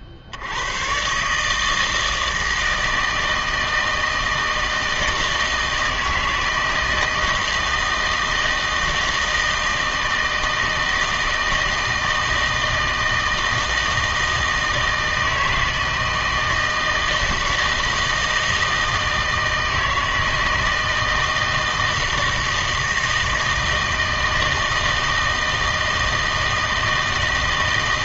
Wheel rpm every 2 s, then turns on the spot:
90, 160, 160, 160, 160, 160, 160, 160, 160, 160, 160, 160, 160, 160.
none